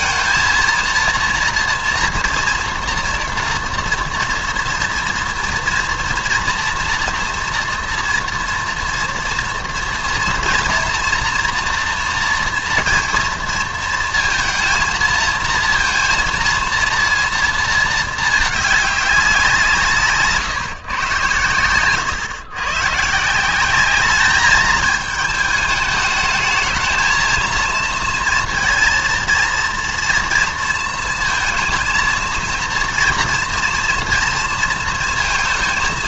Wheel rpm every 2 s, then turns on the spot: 230, 230, 230, 230, 230, 230, 230, 230, 230, 200, 140, 120, 220, 220, 230, 230, 230, 230.
none